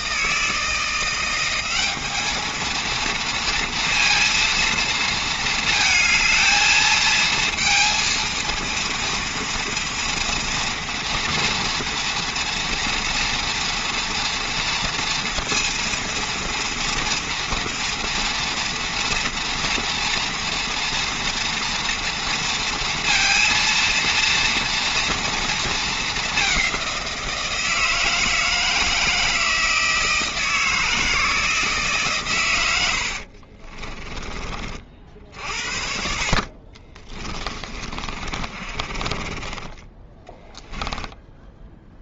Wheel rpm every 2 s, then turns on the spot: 160, 220, 230, 220, 230, 230, 230, 230, 230, 230, 230, 230, 230, 200, 160, 160, 110, 30, 40, 40, 10.
38-42